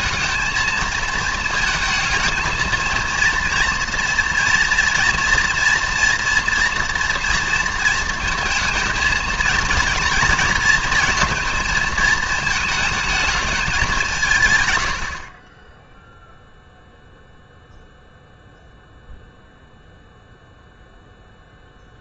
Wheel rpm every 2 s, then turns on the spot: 220, 220, 230, 240, 230, 230, 220, 120, 0, 0, 0.
none